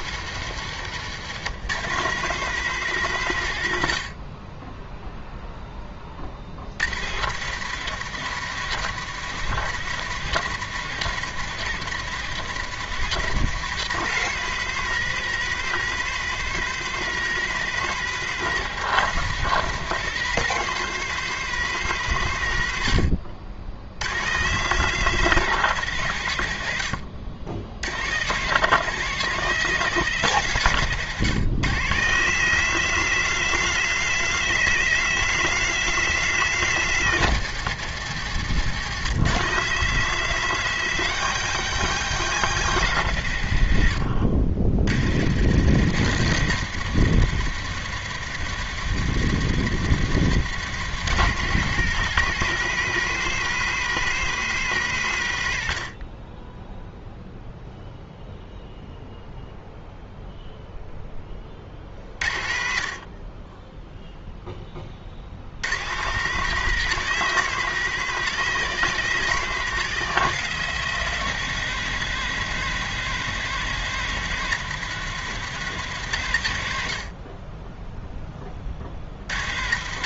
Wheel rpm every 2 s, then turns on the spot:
150, 180, 0, 100, 170, 170, 170, 200, 200, 190, 200, 100, 170, 90, 180, 150, 200, 200, 180, 160, 200, 150, 90, 170, 170, 180, 200, 160, 0, 0, 0, 60, 30, 190, 200, 190, 180, 180, 80, 70.
none